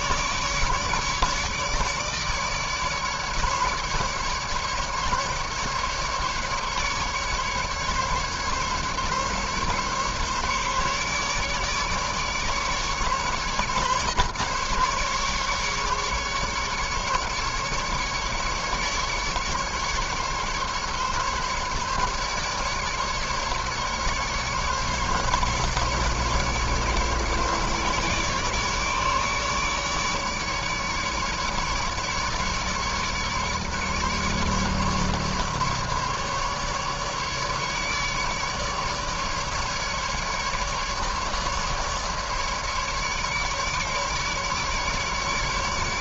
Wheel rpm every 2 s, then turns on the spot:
150, 150, 150, 140, 140, 150, 150, 140, 140, 150, 150, 150, 150, 150, 150, 150, 150, 150, 150, 150, 150, 150, 150.
none